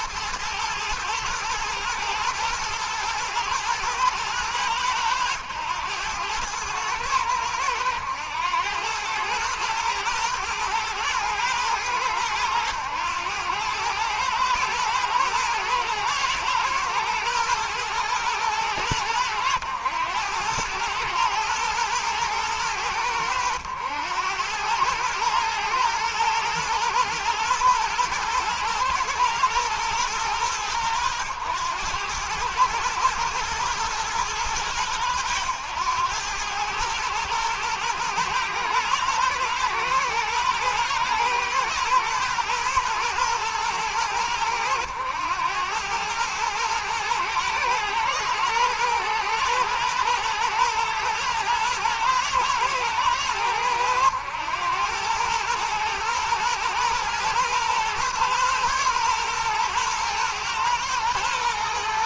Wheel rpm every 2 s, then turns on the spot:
110, 120, 100, 110, 110, 110, 100, 110, 110, 100, 110, 100, 110, 110, 120, 100, 110, 110, 110, 110, 110, 120, 100, 110, 120, 110, 110, 110, 120, 120, 110.
none